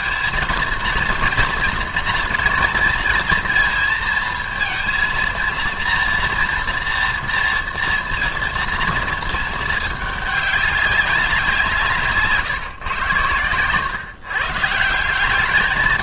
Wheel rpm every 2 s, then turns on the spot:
230, 230, 230, 240, 230, 210, 150, 140.
none